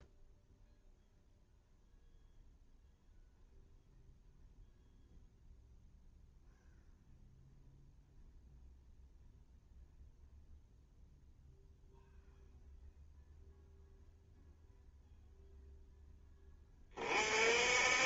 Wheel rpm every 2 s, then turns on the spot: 0, 0, 0, 0, 0, 0, 0, 0, 30.
none